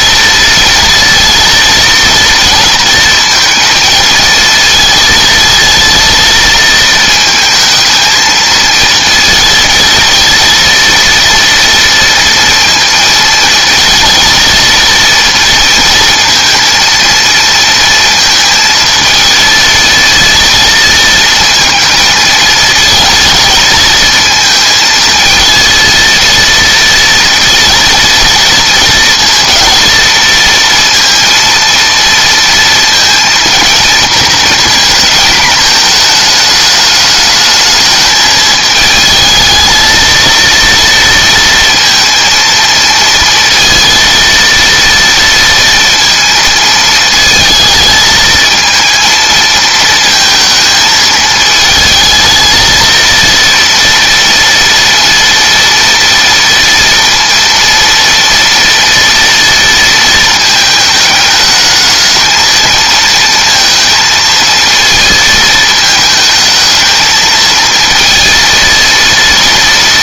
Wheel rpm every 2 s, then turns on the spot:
230, 230, 230, 230, 220, 230, 230, 230, 230, 230, 230, 230, 220, 230, 230, 230, 230, 220, 220, 220, 230, 230, 230, 220, 220, 220, 230, 230, 230, 230, 220, 230, 230, 220, 230.
none